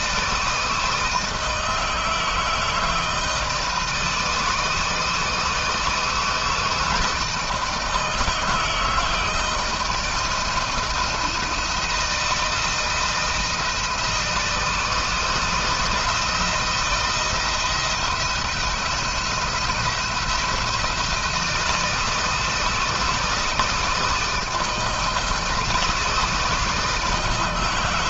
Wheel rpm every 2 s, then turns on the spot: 160, 160, 160, 160, 160, 170, 160, 160, 170, 170, 170, 160, 160, 160.
none